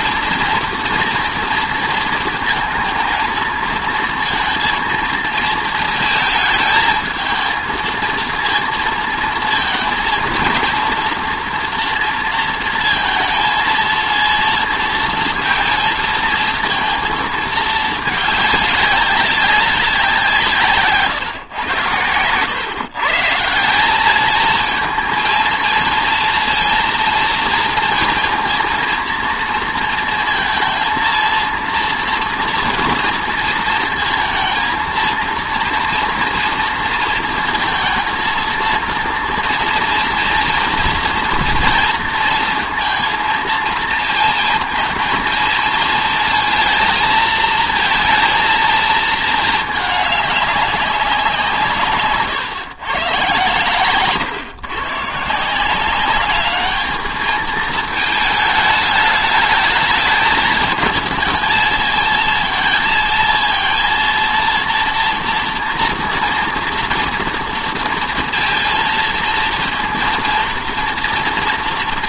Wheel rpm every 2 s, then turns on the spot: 230, 220, 230, 220, 230, 230, 230, 230, 230, 200, 150, 130, 220, 230, 230, 230, 230, 230, 230, 230, 230, 230, 230, 230, 230, 200, 130, 130, 210, 210, 220, 230, 230, 240, 220, 230.
none